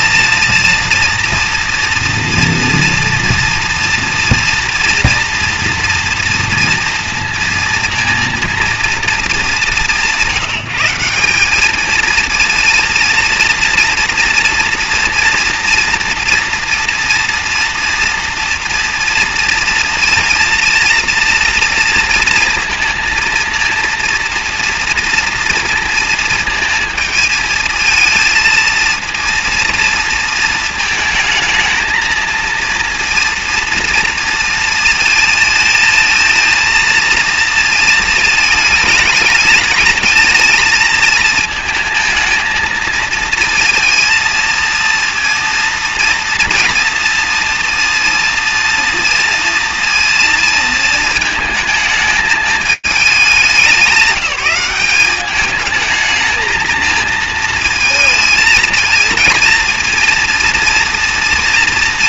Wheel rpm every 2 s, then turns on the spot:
230, 230, 230, 230, 230, 180, 230, 230, 230, 230, 230, 230, 230, 230, 230, 220, 230, 230, 230, 220, 230, 220, 230, 230, 230, 220, 220, 190, 220, 220, 230.
none